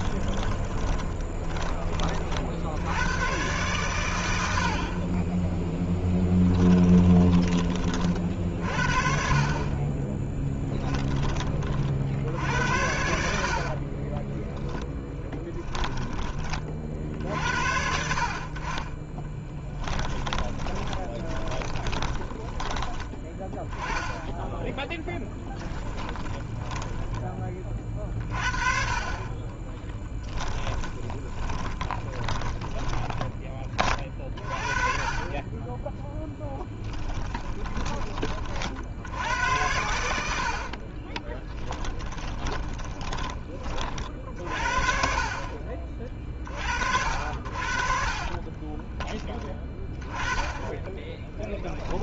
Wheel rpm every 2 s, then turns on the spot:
20, 70, 70, 10, 50, 10, 70, 10, 30, 40, 20, 20, 10, 10, 30, 10, 20, 30, 10, 60, 50, 20, 50, 50, 20, 20.
0-2 6-8 14-16 20-28 30-34 36-38 42-44 48-50